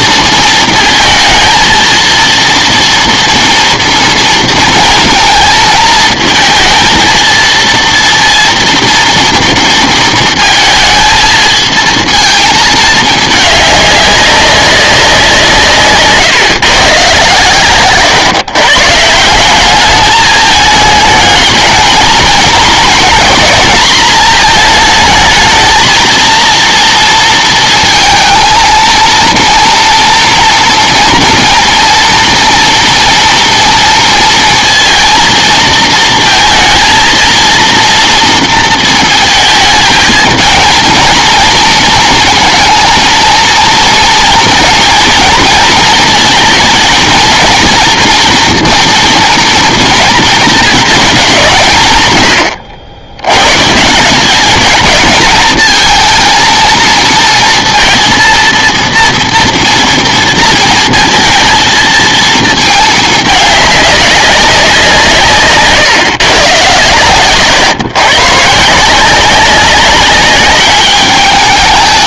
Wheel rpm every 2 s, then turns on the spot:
230, 230, 230, 220, 230, 230, 220, 190, 140, 140, 210, 230, 220, 230, 230, 240, 230, 230, 230, 230, 220, 230, 240, 230, 230, 230, 80, 210, 230, 230, 230, 220, 190, 130, 150, 200.
none